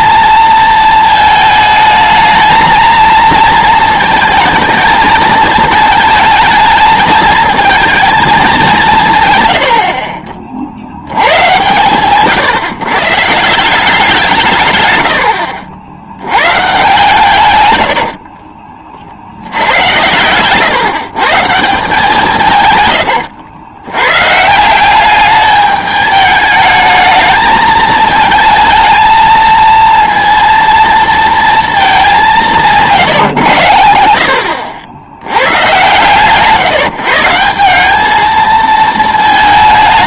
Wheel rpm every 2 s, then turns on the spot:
230, 220, 220, 220, 180, 70, 140, 120, 130, 40, 140, 120, 180, 210, 220, 230, 150, 80, 160, 220.
none